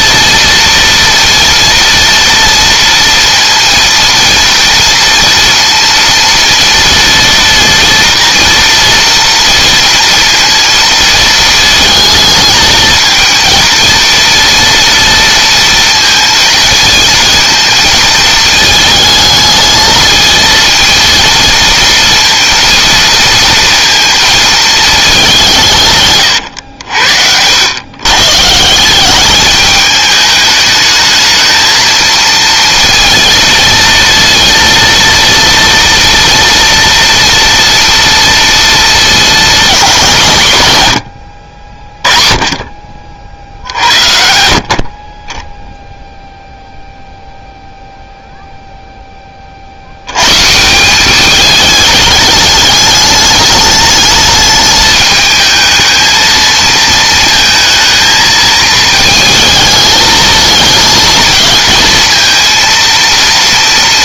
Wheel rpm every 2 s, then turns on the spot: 230, 230, 230, 230, 230, 230, 220, 230, 230, 220, 230, 230, 220, 80, 180, 220, 230, 230, 230, 230, 120, 40, 40, 0, 10, 190, 210, 210, 230, 220, 220, 230.
none